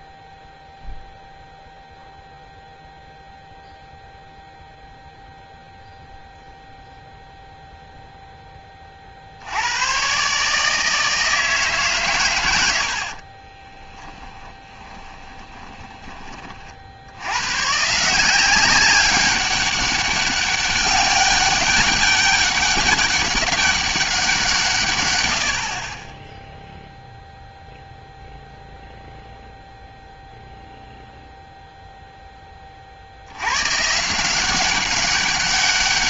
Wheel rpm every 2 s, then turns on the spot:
0, 0, 0, 0, 20, 150, 90, 20, 50, 190, 200, 200, 150, 0, 0, 0, 30, 190.
14-16